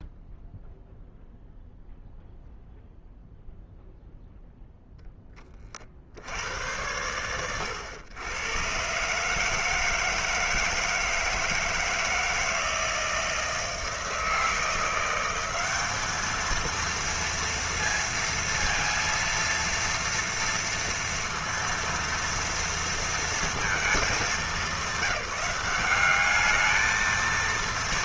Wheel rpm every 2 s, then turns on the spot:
0, 0, 0, 90, 120, 160, 160, 170, 220, 230, 230, 230, 200, 220.
none